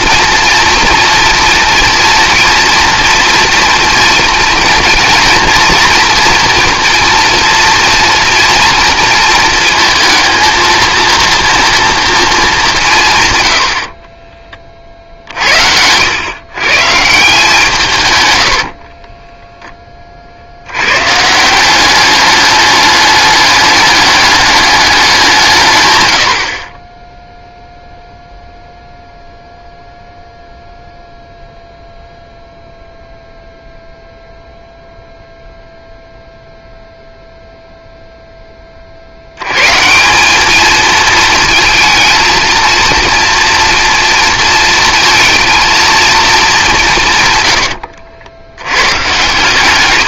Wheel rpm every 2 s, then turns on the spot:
230, 230, 230, 230, 230, 230, 200, 40, 130, 70, 70, 210, 200, 40, 0, 0, 0, 0, 0, 20, 210, 230, 230, 190, 100.
18-20